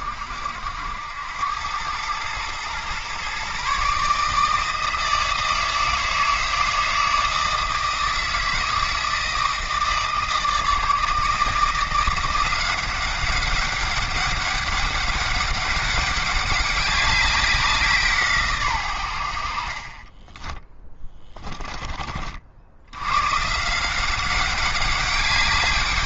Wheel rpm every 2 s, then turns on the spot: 80, 120, 160, 160, 160, 160, 190, 200, 200, 110, 20, 90, 200.
20-22